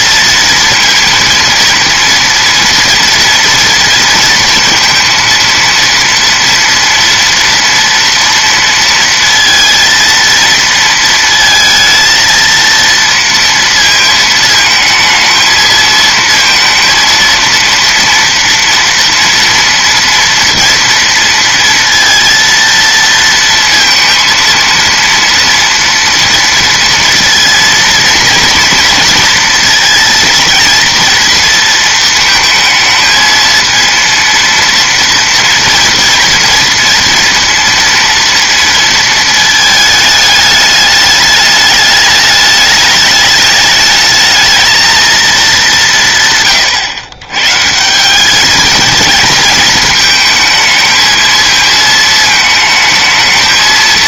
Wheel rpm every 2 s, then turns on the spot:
230, 230, 230, 230, 230, 230, 230, 220, 230, 230, 230, 230, 230, 230, 230, 230, 220, 230, 230, 230, 210, 210, 220, 130, 220, 220, 220.
none